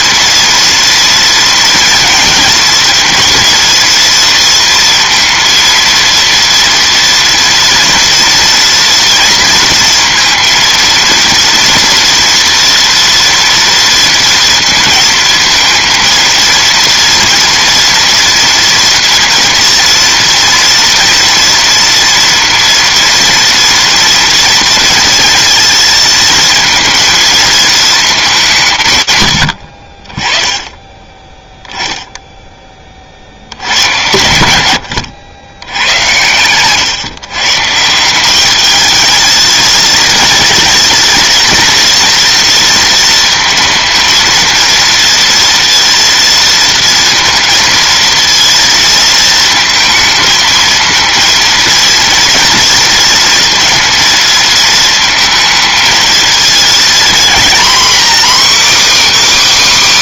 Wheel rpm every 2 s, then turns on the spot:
230, 230, 230, 230, 230, 230, 230, 230, 230, 230, 230, 230, 230, 230, 130, 10, 20, 90, 120, 220, 230, 230, 230, 230, 230, 230, 230, 230, 230, 290.
none